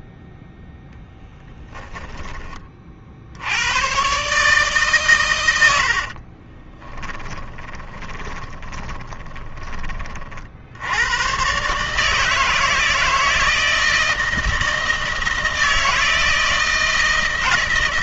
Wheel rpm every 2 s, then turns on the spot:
0, 40, 130, 20, 20, 80, 160, 160, 160.
6-10